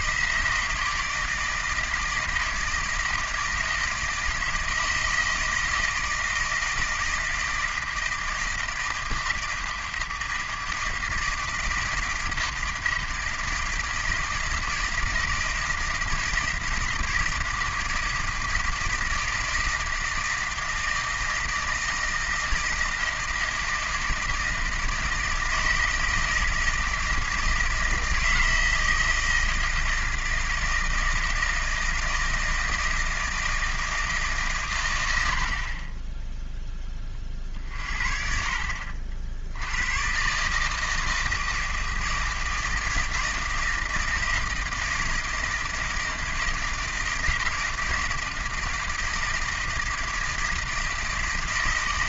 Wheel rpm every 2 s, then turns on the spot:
160, 160, 160, 160, 160, 160, 160, 160, 160, 160, 160, 160, 160, 160, 160, 160, 160, 120, 10, 50, 150, 160, 160, 160, 160, 160.
none